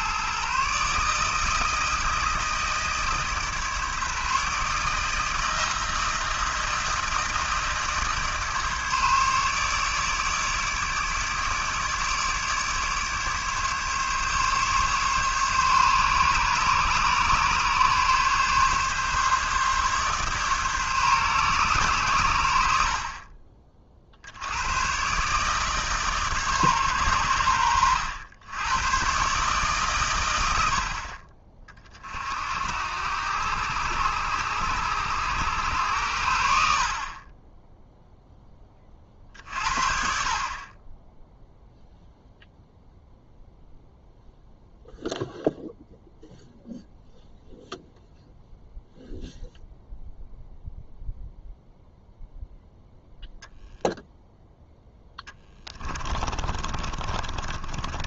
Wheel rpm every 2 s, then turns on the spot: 140, 160, 150, 160, 150, 150, 150, 140, 140, 140, 140, 80, 100, 140, 110, 70, 80, 100, 60, 20, 20, 0, 0, 0, 0, 0, 0, 0, 30.
56-58